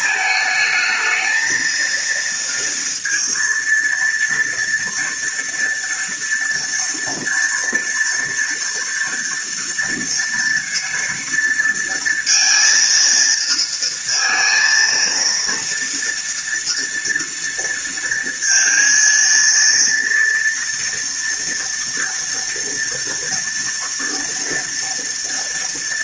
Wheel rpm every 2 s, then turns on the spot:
220, 230, 230, 240, 230, 230, 230, 230, 230, 230, 240, 230, 230.
none